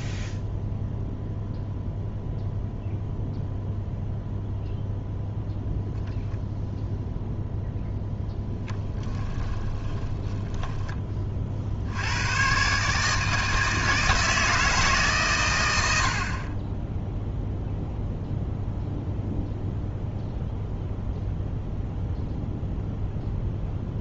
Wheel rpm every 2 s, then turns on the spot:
0, 0, 0, 0, 10, 20, 140, 150, 10, 0, 0, 0.
8-12